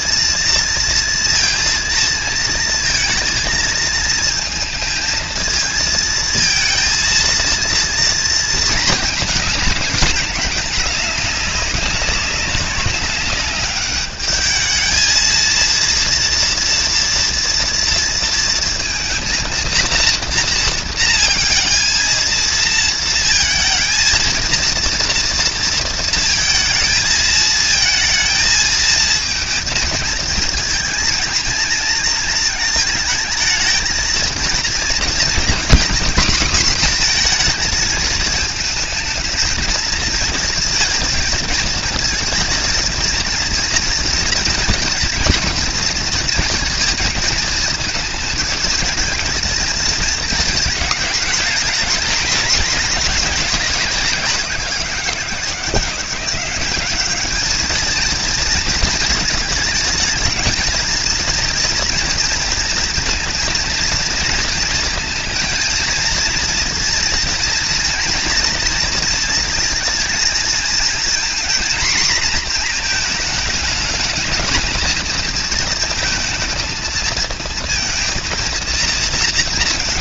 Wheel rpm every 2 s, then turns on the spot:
230, 220, 220, 230, 230, 210, 200, 210, 230, 230, 230, 230, 230, 230, 220, 230, 220, 230, 240, 220, 230, 230, 230, 230, 220, 220, 220, 180, 190, 220, 230, 230, 230, 230, 230, 220, 230, 220, 220, 220.
none